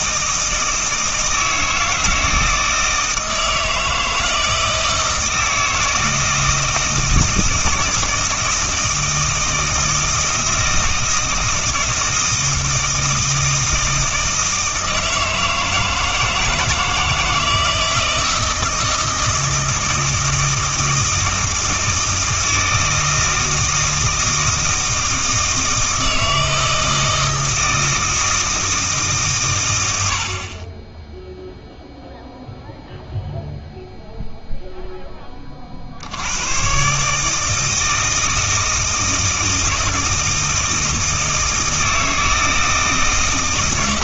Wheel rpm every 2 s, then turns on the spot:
160, 160, 160, 160, 160, 160, 160, 160, 160, 160, 160, 160, 160, 160, 160, 20, 0, 0, 130, 160, 160, 160.
none